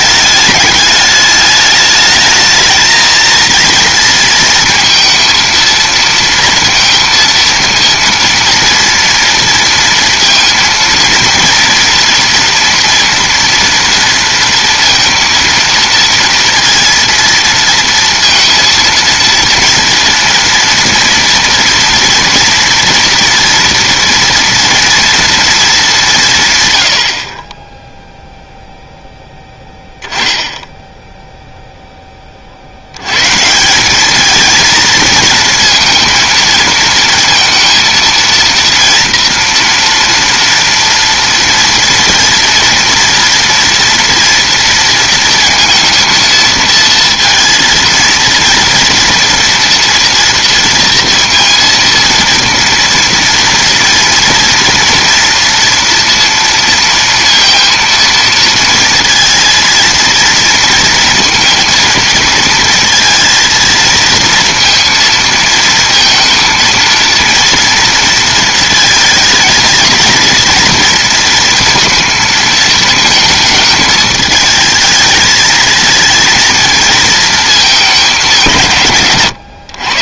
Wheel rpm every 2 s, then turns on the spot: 210, 220, 230, 230, 230, 230, 230, 230, 230, 230, 240, 230, 230, 130, 0, 10, 60, 230, 230, 230, 230, 230, 230, 230, 230, 230, 230, 230, 230, 230, 230, 230, 230, 230, 230, 230, 220, 220, 230, 160.
none